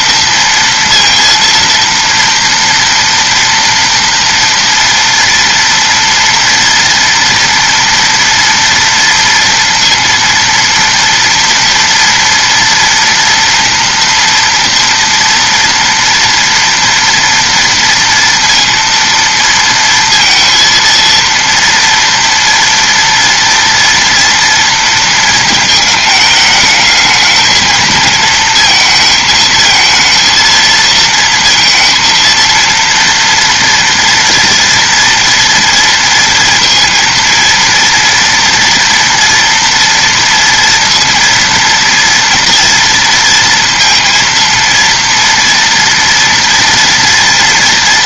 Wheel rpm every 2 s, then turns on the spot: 230, 230, 240, 230, 230, 230, 230, 230, 230, 230, 230, 230, 230, 220, 220, 230, 230, 230, 230, 230, 230, 230, 230, 230.
none